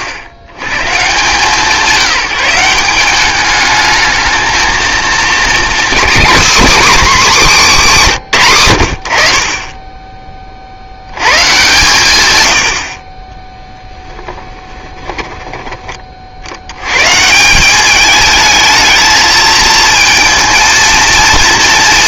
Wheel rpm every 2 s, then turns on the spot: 110, 170, 230, 280, 100, 60, 90, 20, 90, 220, 230.
14-16